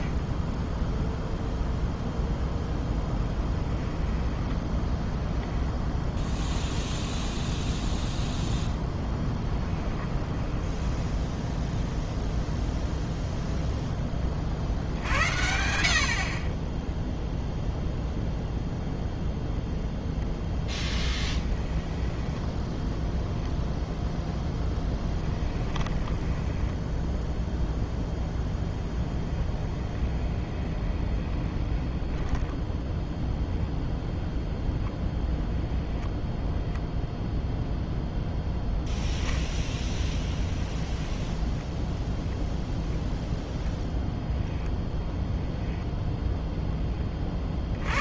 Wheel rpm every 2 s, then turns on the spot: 0, 0, 10, 0, 0, 10, 0, 50, 20, 0, 10, 10, 10, 10, 10, 20, 10, 0, 0, 0, 0, 0, 10, 10.
4-6 10-12 20-24 26-32